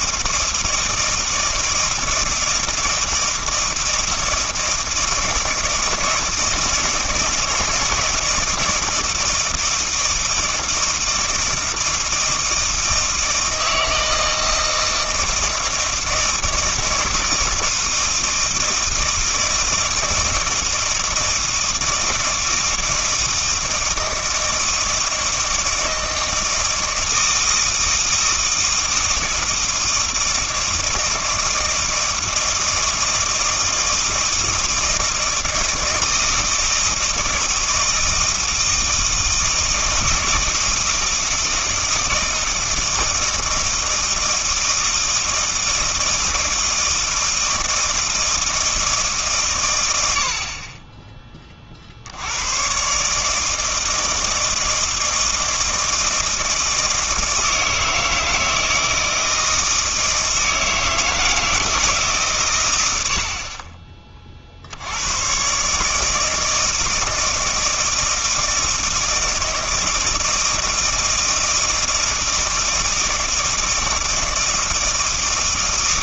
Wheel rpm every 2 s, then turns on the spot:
160, 160, 160, 160, 160, 160, 160, 160, 160, 160, 160, 160, 160, 160, 160, 160, 160, 160, 160, 160, 160, 160, 160, 160, 160, 40, 110, 160, 160, 160, 160, 120, 50, 160, 160, 160, 160, 160.
none